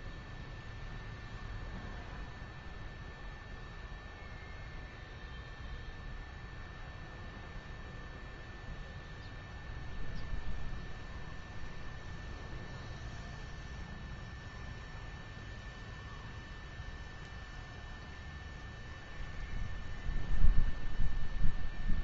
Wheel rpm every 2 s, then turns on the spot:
0, 0, 0, 0, 0, 0, 0, 0, 0, 0, 0.
none